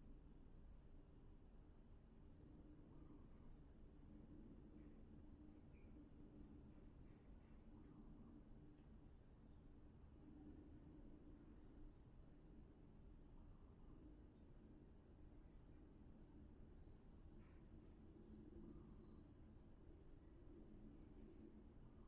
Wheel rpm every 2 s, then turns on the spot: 0, 0, 0, 0, 0, 0, 0, 0, 0, 0, 0.
none